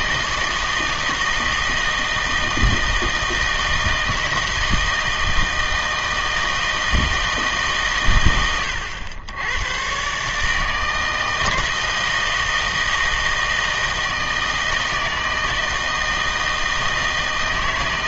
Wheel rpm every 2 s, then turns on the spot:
160, 160, 160, 160, 100, 160, 160, 160, 160.
none